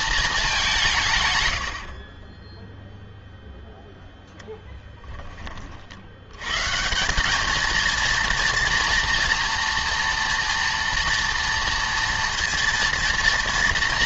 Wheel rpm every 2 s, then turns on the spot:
190, 0, 10, 130, 230, 240, 230.
none